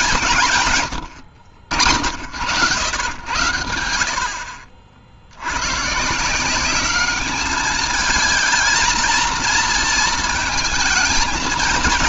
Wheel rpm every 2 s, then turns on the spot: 120, 90, 60, 190, 220, 220.
none